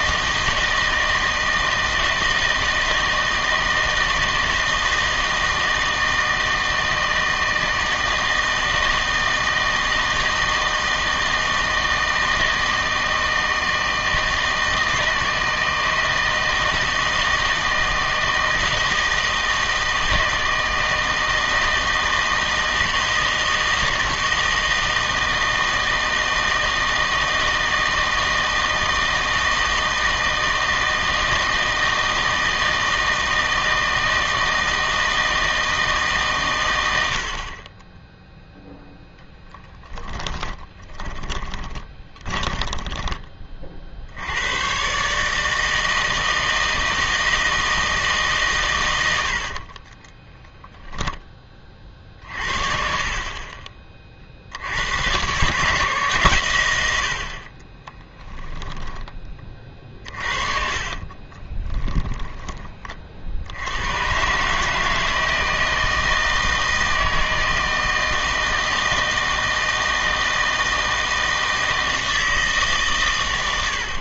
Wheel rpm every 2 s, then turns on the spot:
160, 160, 160, 160, 160, 160, 160, 160, 160, 160, 160, 160, 160, 160, 160, 160, 160, 160, 110, 0, 20, 20, 120, 160, 130, 10, 40, 70, 110, 10, 40, 20, 150, 160, 160, 160, 140.
40-44 50-52 58-62